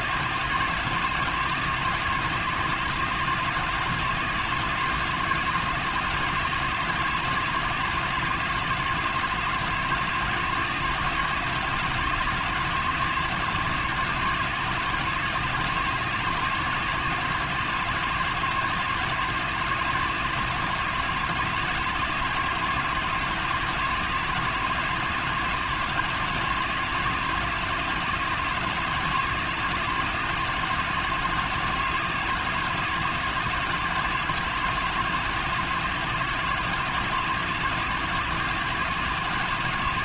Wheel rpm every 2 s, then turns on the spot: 160, 160, 170, 160, 160, 160, 160, 160, 160, 160, 160, 170, 160, 170, 160, 170, 160, 170, 160, 170.
none